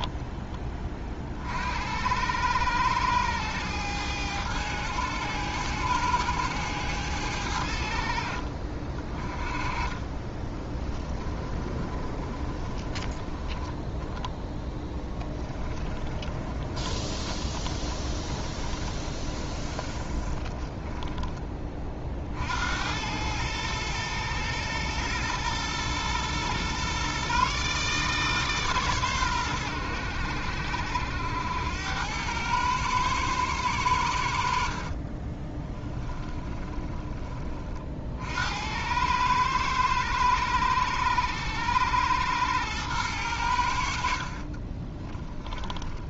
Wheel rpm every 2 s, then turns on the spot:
30, 100, 100, 100, 40, 20, 20, 10, 30, 20, 20, 80, 110, 130, 130, 70, 110, 50, 20, 90, 100, 110, 30.
10-22 34-38 44-46